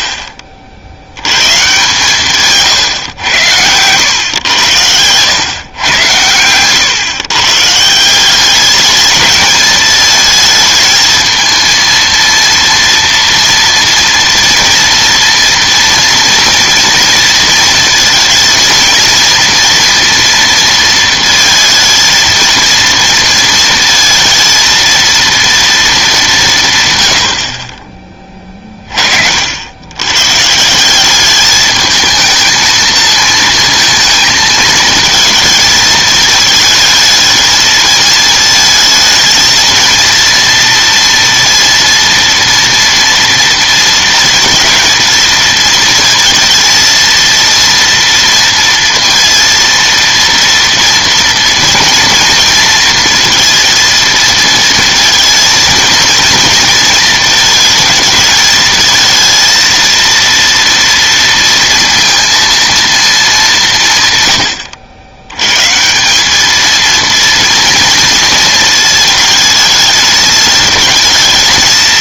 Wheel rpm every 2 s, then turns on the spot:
50, 140, 110, 110, 200, 220, 230, 230, 230, 230, 230, 230, 230, 160, 30, 160, 220, 220, 220, 220, 230, 240, 230, 230, 230, 230, 230, 230, 230, 220, 230, 230, 100, 220, 220, 220.
none